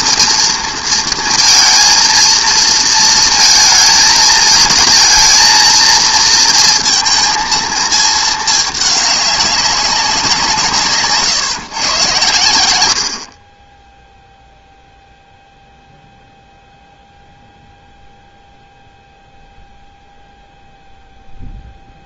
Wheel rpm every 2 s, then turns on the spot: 230, 230, 220, 230, 210, 160, 90, 0, 0, 0, 0.
none